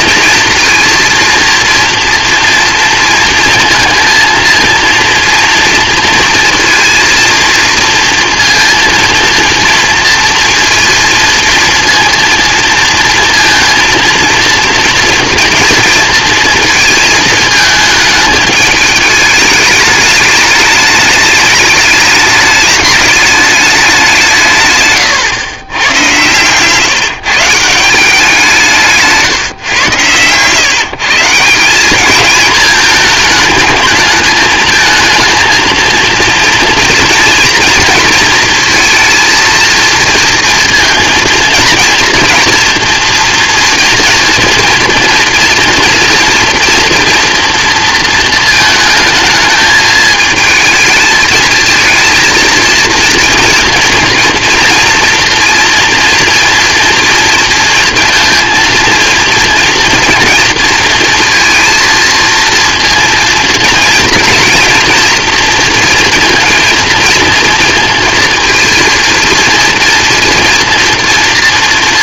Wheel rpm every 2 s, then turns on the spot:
230, 230, 230, 230, 230, 230, 230, 230, 220, 220, 210, 210, 130, 140, 160, 140, 220, 220, 230, 230, 230, 230, 230, 230, 230, 220, 230, 230, 240, 230, 230, 230, 230, 230, 230, 230.
none